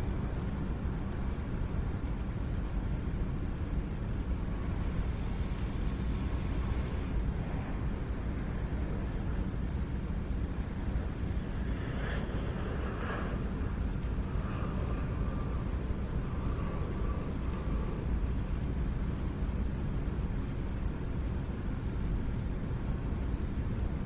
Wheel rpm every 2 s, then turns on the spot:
0, 0, 0, 0, 0, 0, 0, 0, 0, 0, 0, 0.
none